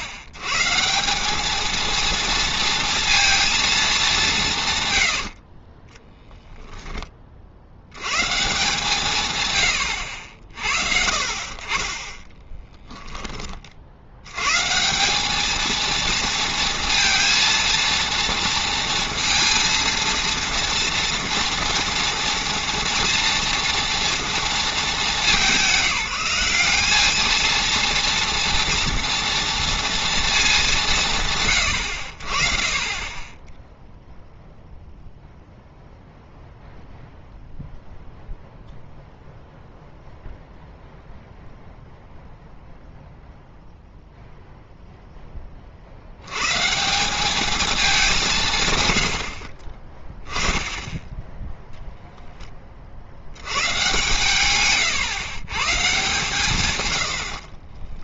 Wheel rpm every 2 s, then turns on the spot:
120, 230, 140, 10, 160, 60, 10, 140, 230, 230, 230, 230, 220, 190, 230, 200, 40, 0, 0, 0, 0, 0, 0, 130, 140, 10, 20, 120, 130.
12-14